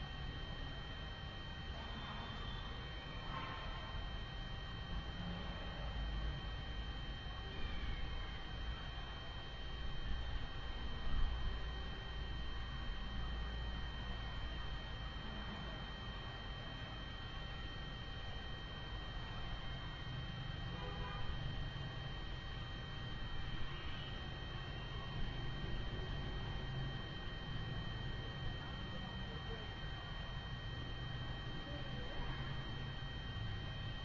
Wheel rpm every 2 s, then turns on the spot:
0, 0, 0, 0, 0, 0, 0, 0, 0, 0, 0, 0, 0, 0, 0, 0, 0.
none